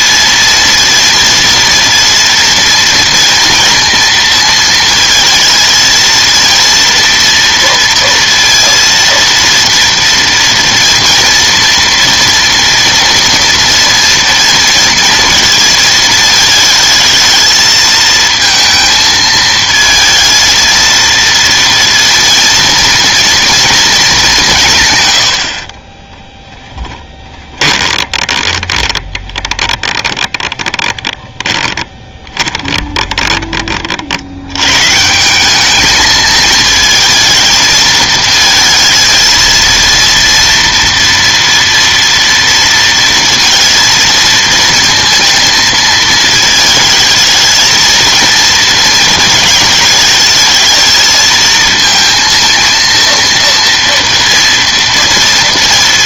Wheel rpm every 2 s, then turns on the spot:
230, 230, 230, 230, 230, 230, 230, 230, 220, 220, 230, 230, 170, 10, 20, 20, 20, 110, 220, 220, 230, 230, 230, 220, 230, 220, 230, 230.
26-34